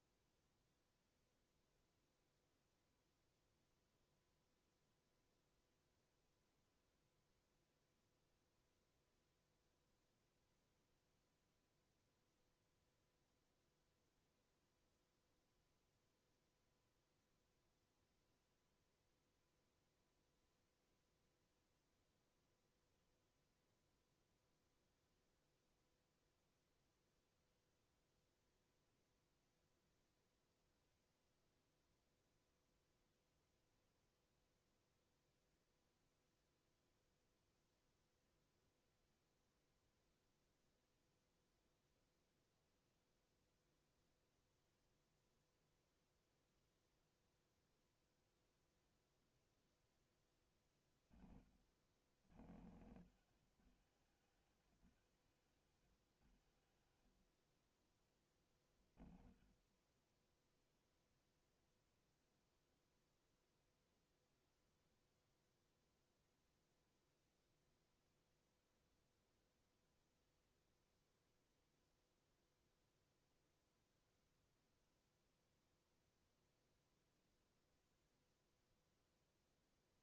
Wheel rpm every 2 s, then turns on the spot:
0, 0, 0, 0, 0, 0, 0, 0, 0, 0, 0, 0, 0, 0, 0, 0, 0, 0, 0, 0, 0, 0, 0, 0, 0, 20, 90, 50, 30, 30, 0, 0, 0, 0, 0, 0, 0, 0, 0, 0.
none